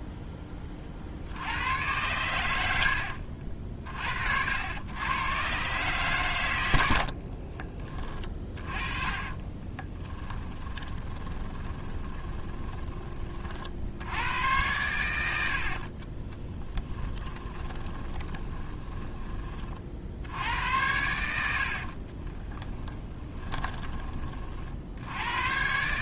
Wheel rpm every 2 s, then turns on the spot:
40, 70, 100, 70, 30, 20, 20, 100, 10, 20, 90, 10, 60.
6-12 16-20 22-24